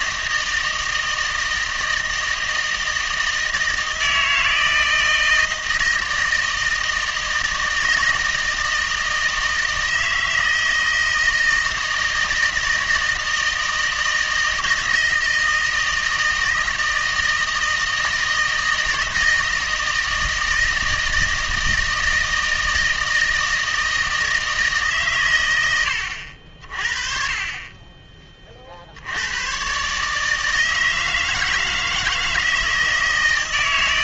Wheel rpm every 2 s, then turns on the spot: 160, 160, 160, 160, 160, 160, 160, 160, 160, 160, 160, 160, 150, 40, 60, 160, 160.
none